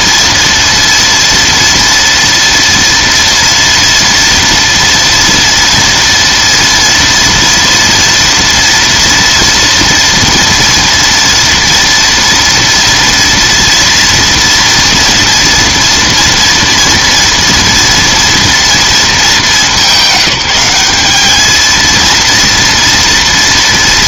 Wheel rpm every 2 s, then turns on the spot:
230, 230, 230, 230, 230, 230, 230, 230, 230, 230, 210, 230.
none